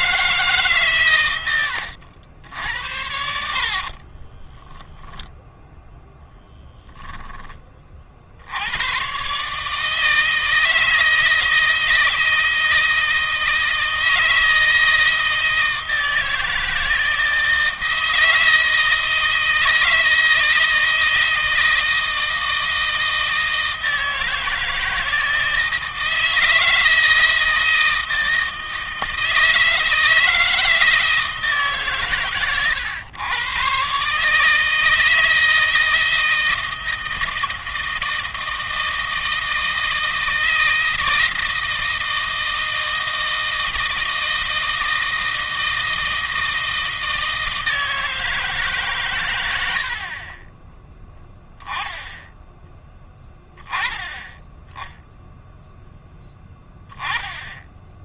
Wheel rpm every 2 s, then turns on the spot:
120, 70, 0, 20, 120, 160, 160, 160, 160, 160, 160, 160, 160, 160, 160, 160, 120, 160, 160, 160, 160, 160, 160, 160, 130, 20, 20, 10, 10.
none